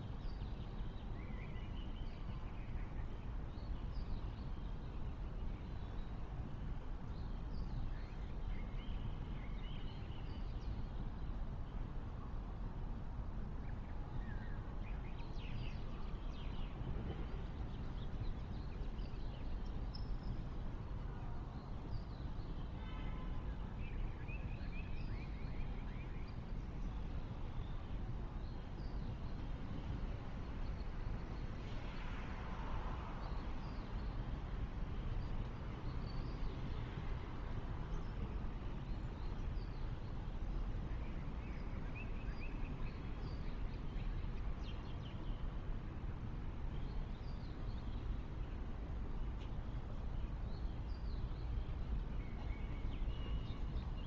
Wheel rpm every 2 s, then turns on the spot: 0, 0, 0, 0, 0, 0, 0, 0, 0, 0, 0, 0, 0, 0, 0, 0, 0, 0, 0, 0, 0, 0, 0, 0, 0, 0, 0.
none